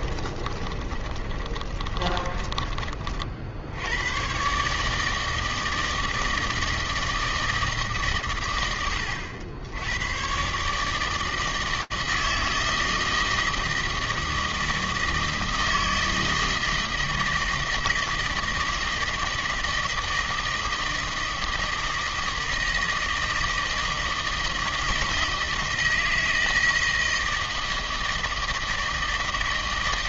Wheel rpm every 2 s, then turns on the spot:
30, 40, 150, 160, 140, 110, 160, 160, 160, 160, 160, 160, 160, 160, 160.
0-2